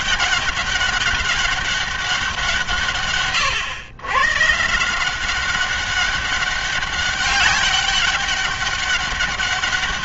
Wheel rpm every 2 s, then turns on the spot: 200, 150, 160, 200, 200.
none